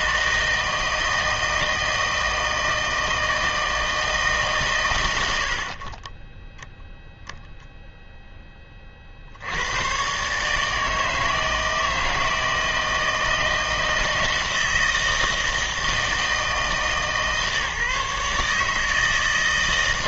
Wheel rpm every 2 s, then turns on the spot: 160, 160, 110, 0, 40, 160, 160, 160, 160, 160.
none